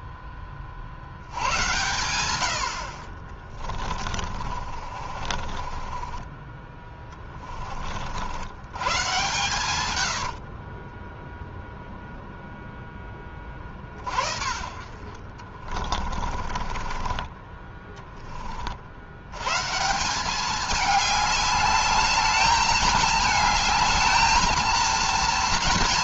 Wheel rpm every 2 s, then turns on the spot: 60, 50, 40, 20, 110, 20, 10, 50, 20, 60, 200, 210, 230.
4-8 10-12 14-18